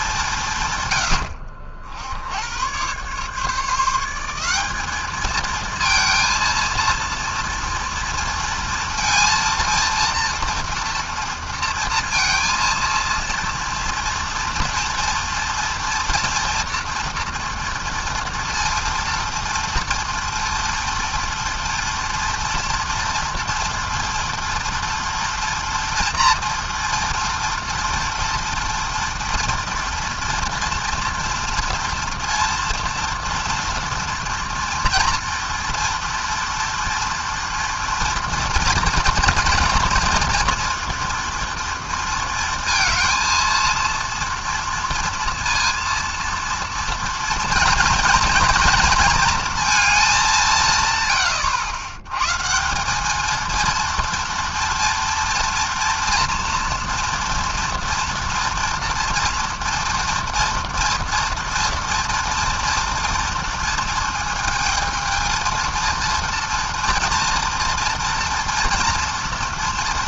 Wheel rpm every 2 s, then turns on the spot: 90, 140, 220, 230, 230, 230, 230, 240, 230, 230, 230, 230, 230, 230, 240, 230, 230, 240, 230, 230, 230, 230, 230, 230, 230, 100, 220, 230, 240, 230, 230, 230, 220, 230, 230.
none